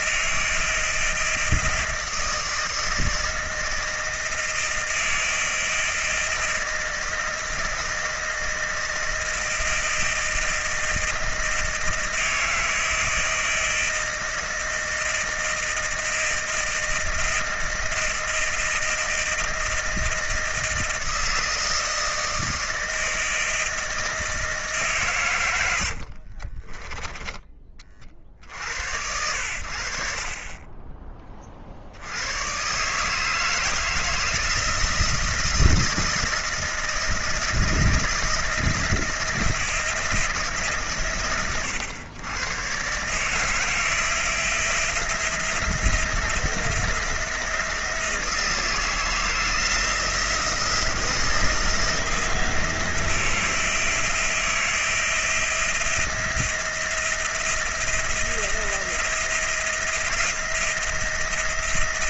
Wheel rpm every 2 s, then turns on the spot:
160, 160, 160, 160, 160, 160, 160, 160, 160, 160, 160, 160, 140, 20, 80, 30, 140, 160, 160, 160, 140, 130, 170, 170, 160, 160, 170, 170, 170, 170, 160.
26-28